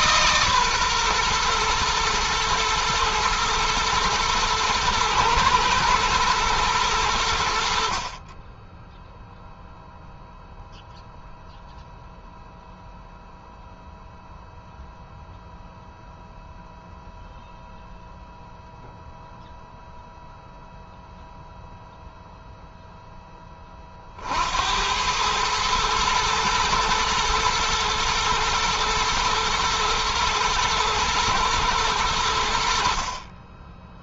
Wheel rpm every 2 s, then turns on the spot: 130, 110, 120, 90, 0, 0, 0, 0, 0, 0, 0, 10, 90, 110, 110, 110, 50.
none